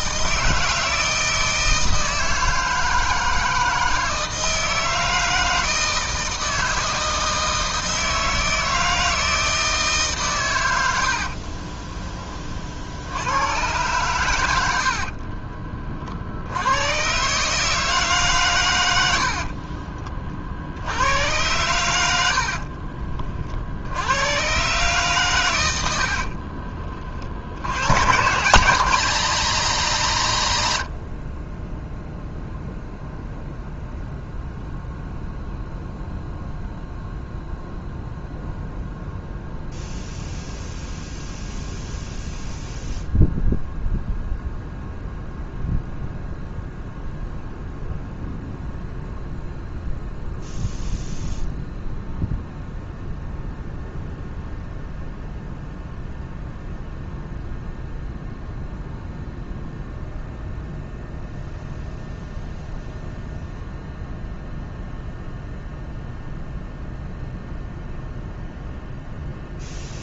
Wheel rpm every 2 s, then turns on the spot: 160, 160, 160, 160, 160, 70, 70, 60, 120, 80, 100, 30, 130, 40, 200, 50, 0, 0, 0, 0, 0, 0, 0, 0, 0, 0, 0, 0, 0, 0, 0, 0, 0, 0, 0.
10-12 18-20